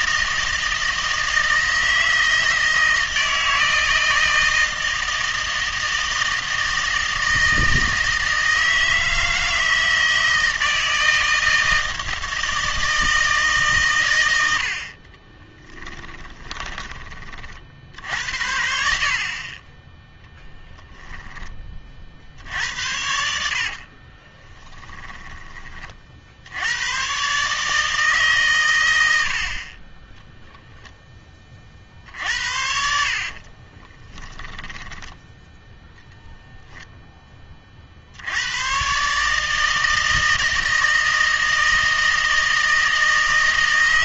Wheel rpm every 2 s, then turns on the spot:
160, 160, 160, 160, 160, 160, 160, 70, 20, 70, 0, 80, 10, 90, 120, 0, 60, 10, 0, 110, 160, 160.
16-18 24-26 32-36